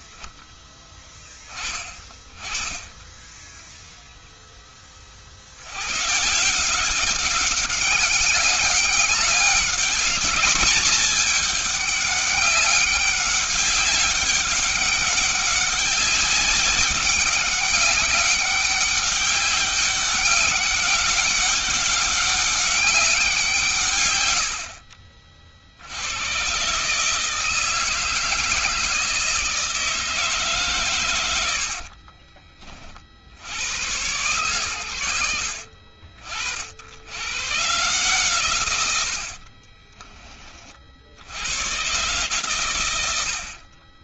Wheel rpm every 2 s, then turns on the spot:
20, 10, 80, 200, 200, 200, 200, 200, 200, 200, 190, 170, 60, 160, 160, 100, 90, 90, 110, 70, 60, 90.
30-32 38-40